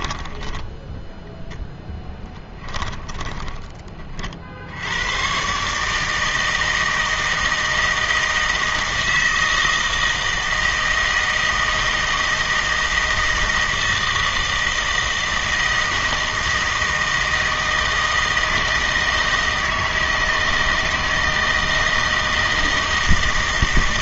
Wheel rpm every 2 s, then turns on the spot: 10, 10, 60, 160, 160, 160, 160, 160, 160, 160, 160, 160.
0-4